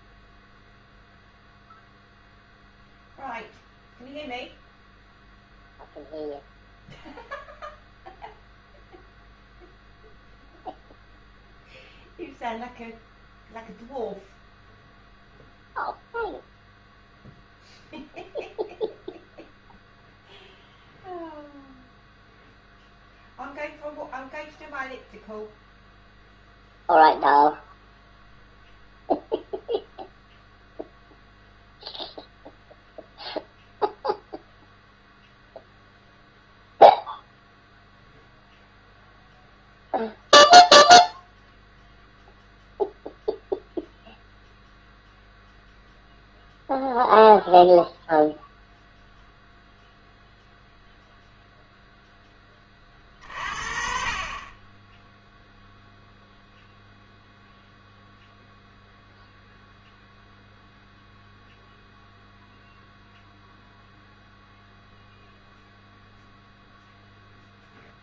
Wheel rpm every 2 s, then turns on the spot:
0, 0, 0, 0, 0, 0, 0, 0, 0, 0, 0, 0, 0, 0, 0, 0, 0, 0, 0, 0, 0, 0, 0, 0, 0, 0, 30, 20, 0, 0, 0, 0, 0, 0.
none